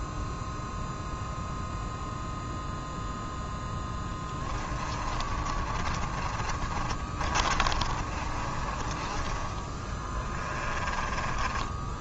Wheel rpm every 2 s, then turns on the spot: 0, 0, 20, 30, 30, 20.
4-12